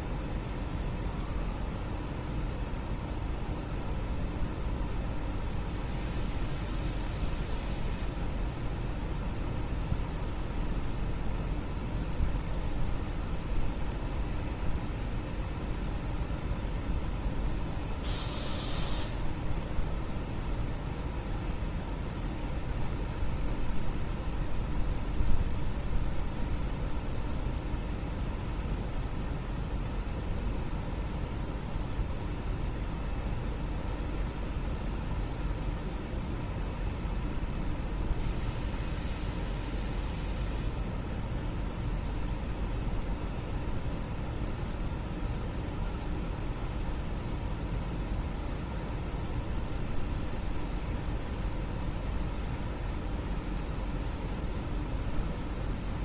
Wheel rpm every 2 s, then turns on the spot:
0, 0, 0, 0, 0, 0, 0, 0, 0, 0, 0, 0, 0, 0, 0, 0, 0, 0, 0, 0, 0, 0, 0, 0, 0, 0, 0, 0.
none